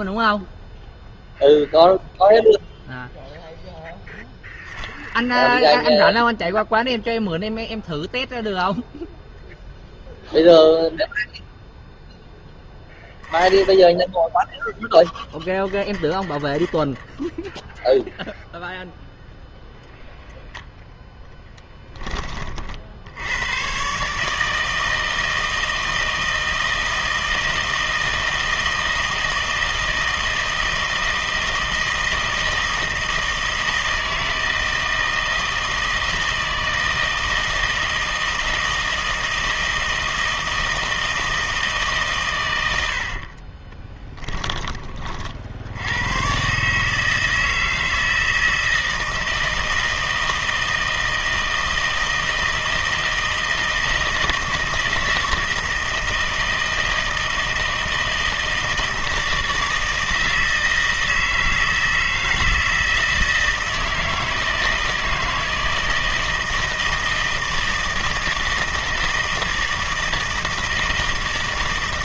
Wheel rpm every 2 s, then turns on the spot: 0, 0, 0, 0, 0, 0, 10, 0, 0, 0, 0, 40, 160, 160, 160, 160, 160, 160, 160, 160, 160, 100, 20, 140, 160, 160, 160, 160, 160, 160, 160, 160, 160, 160, 160, 160.
none